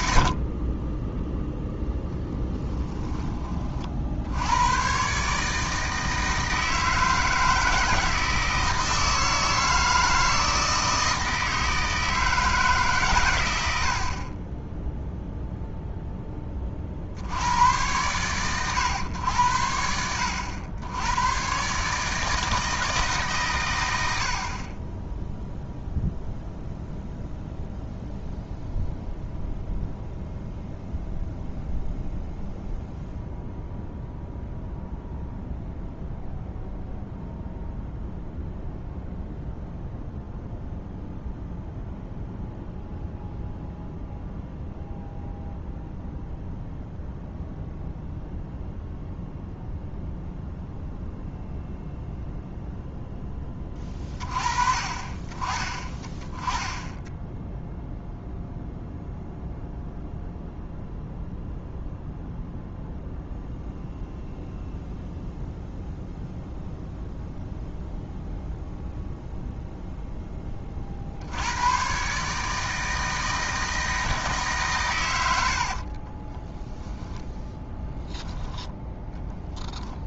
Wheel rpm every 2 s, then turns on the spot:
20, 20, 110, 160, 160, 160, 150, 10, 40, 110, 90, 160, 20, 0, 0, 0, 0, 0, 0, 0, 0, 0, 0, 0, 0, 0, 0, 30, 10, 0, 0, 0, 0, 0, 0, 40, 160, 130, 10, 10.
none